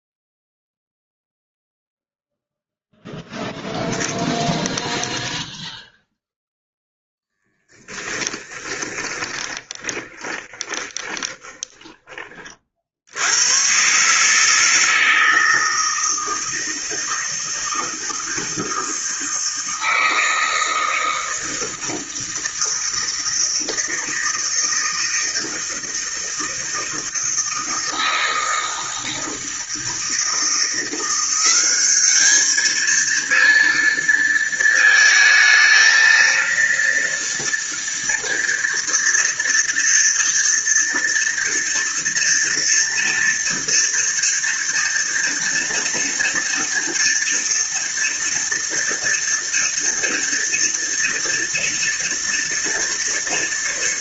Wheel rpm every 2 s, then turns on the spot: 0, 0, 0, 0, 10, 20, 30, 150, 160, 160, 160, 160, 160, 160, 160, 160, 210, 230, 230, 230, 230, 230, 230, 230, 230, 230, 230.
8-12